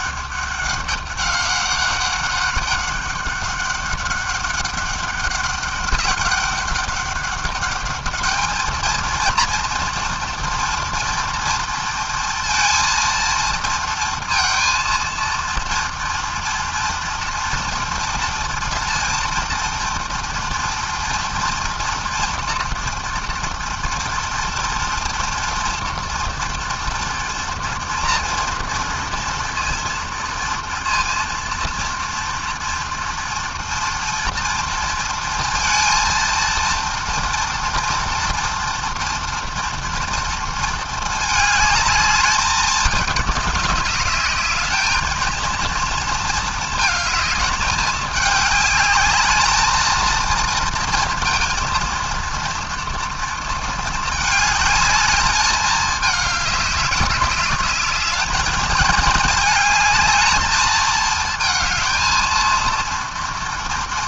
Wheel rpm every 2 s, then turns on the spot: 200, 200, 200, 200, 230, 230, 230, 230, 230, 230, 230, 230, 240, 230, 230, 230, 230, 230, 230, 240, 220, 210, 220, 220, 220, 230, 230, 210, 200, 220, 220, 230.
none